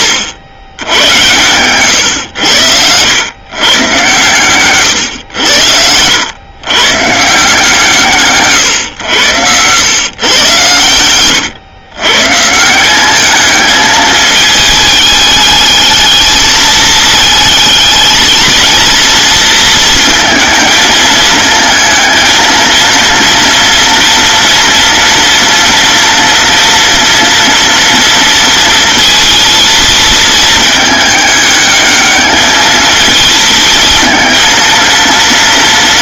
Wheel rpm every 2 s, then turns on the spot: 100, 90, 130, 120, 130, 120, 170, 220, 220, 230, 230, 230, 230, 230, 230, 210, 220, 230.
none